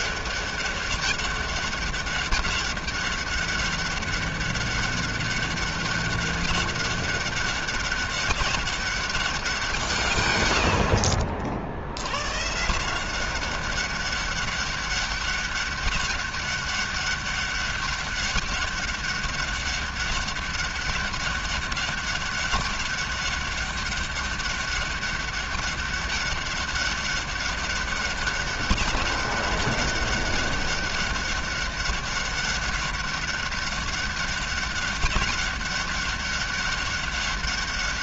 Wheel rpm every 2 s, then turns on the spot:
200, 200, 200, 200, 200, 70, 150, 200, 200, 200, 200, 200, 200, 200, 190, 200, 200, 200, 200.
none